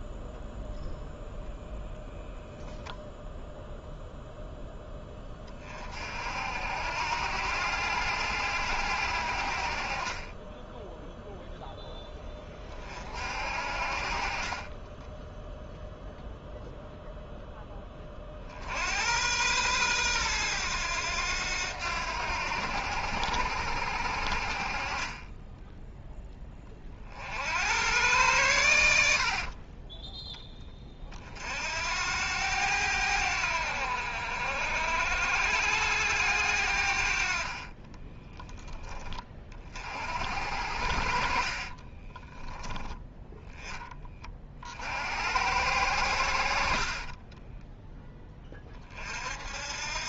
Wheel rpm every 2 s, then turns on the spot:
0, 0, 10, 70, 90, 10, 40, 30, 0, 60, 100, 90, 40, 30, 90, 20, 90, 70, 80, 20, 70, 10, 50, 60, 30.
10-12 14-16 28-30 46-48